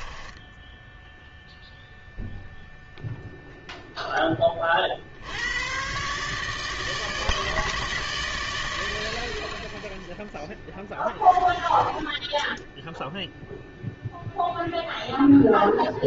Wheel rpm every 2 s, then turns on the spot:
10, 0, 20, 150, 100, 10, 10, 0.
0-2